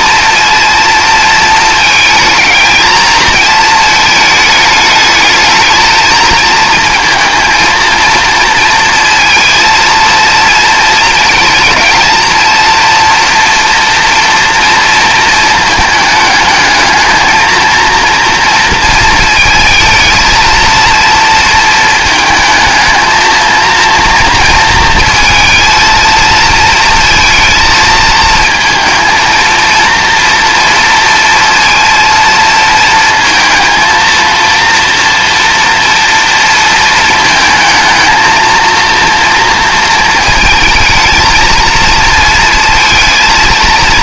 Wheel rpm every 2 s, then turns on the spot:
230, 220, 210, 220, 230, 230, 230, 230, 220, 230, 230, 220, 230, 230, 230, 230, 230, 230, 230, 230, 230, 230.
none